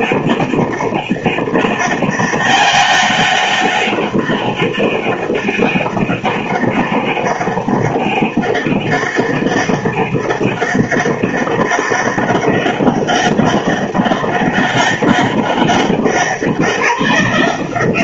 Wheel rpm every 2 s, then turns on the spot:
200, 200, 190, 200, 200, 200, 200, 200, 180.
none